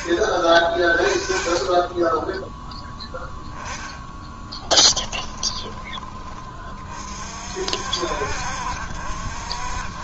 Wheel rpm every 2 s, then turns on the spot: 20, 10, 20, 40, 60.
2-6